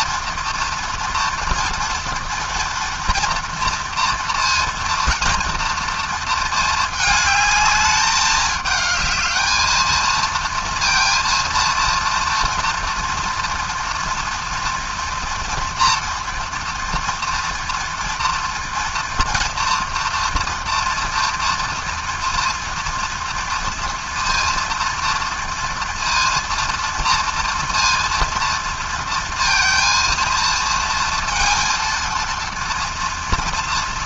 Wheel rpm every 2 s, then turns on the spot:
230, 230, 230, 230, 210, 230, 230, 230, 230, 230, 230, 230, 230, 230, 230, 230, 230.
none